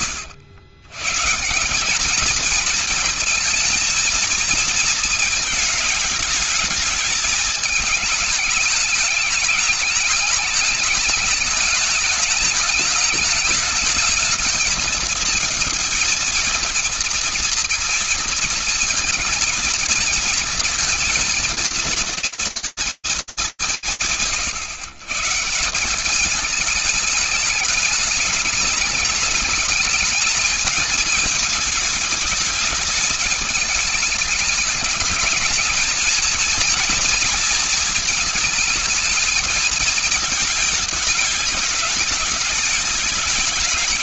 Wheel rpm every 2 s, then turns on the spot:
110, 220, 230, 220, 210, 210, 210, 220, 230, 230, 220, 220, 130, 210, 220, 220, 220, 200, 230, 220, 220, 210.
none